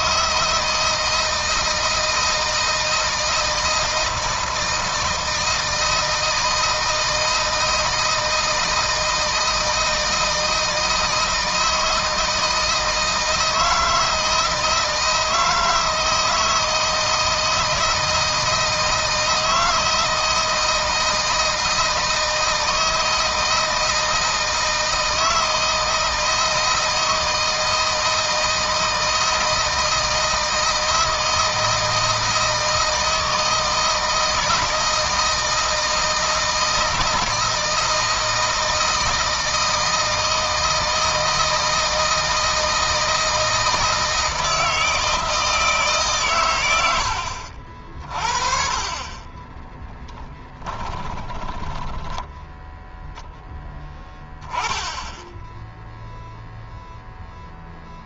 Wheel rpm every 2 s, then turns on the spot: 160, 160, 160, 160, 160, 160, 160, 160, 160, 160, 160, 160, 160, 160, 160, 160, 160, 160, 160, 160, 160, 160, 160, 110, 40, 20, 10, 10, 0.
50-52